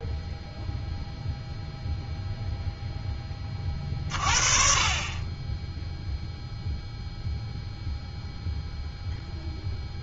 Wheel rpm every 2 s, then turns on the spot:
0, 0, 40, 0, 0.
none